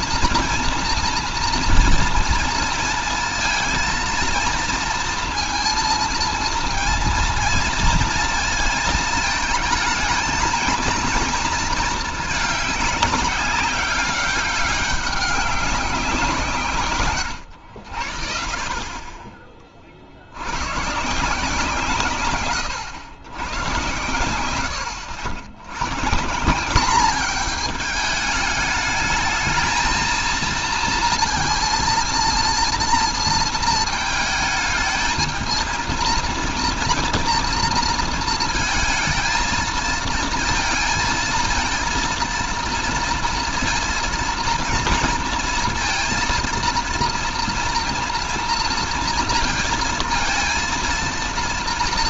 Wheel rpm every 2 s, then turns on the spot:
230, 230, 230, 230, 230, 230, 210, 200, 150, 40, 110, 120, 90, 190, 210, 230, 230, 210, 240, 230, 230, 230, 230, 230, 230, 230.
none